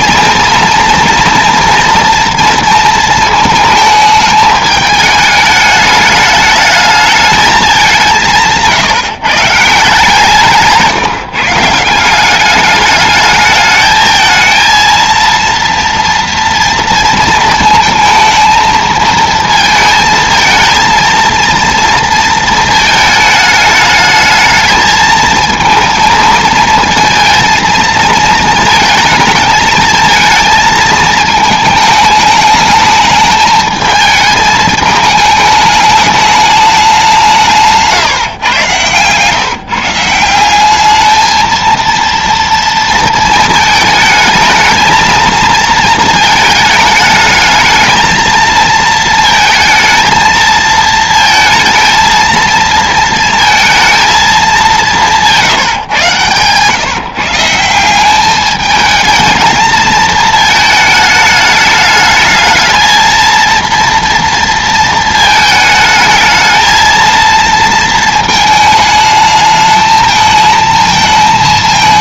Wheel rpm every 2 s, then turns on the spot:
230, 230, 210, 210, 160, 160, 200, 230, 230, 220, 230, 220, 220, 220, 220, 230, 210, 210, 200, 130, 190, 230, 220, 220, 220, 220, 230, 200, 130, 210, 220, 220, 230, 220, 220, 220.
8-10